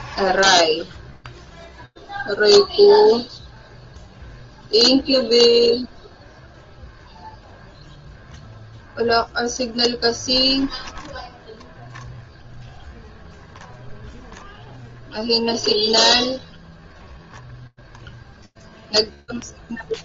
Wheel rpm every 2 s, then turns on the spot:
0, 0, 0, 0, 10, 0, 0, 0, 0, 0.
none